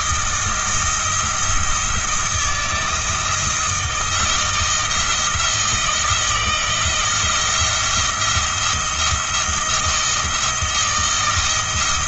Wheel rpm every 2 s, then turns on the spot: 170, 170, 160, 170, 170, 160.
none